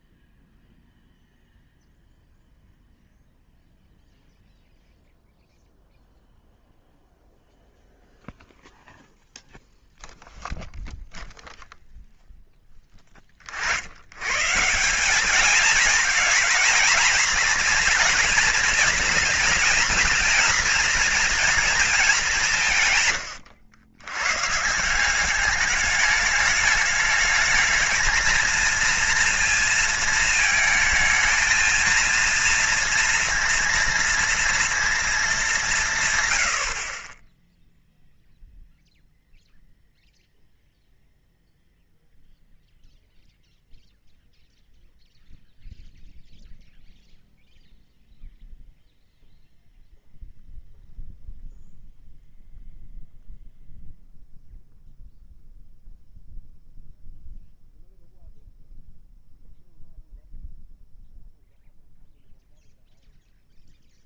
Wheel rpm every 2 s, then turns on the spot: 0, 0, 0, 0, 0, 0, 10, 150, 220, 230, 230, 170, 160, 210, 230, 220, 230, 230, 50, 0, 0, 0, 0, 0, 0, 0, 0, 0, 0, 0, 0, 0.
none